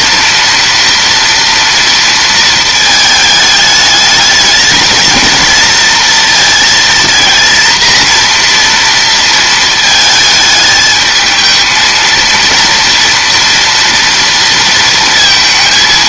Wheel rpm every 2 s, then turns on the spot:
240, 230, 220, 230, 230, 220, 230, 230.
none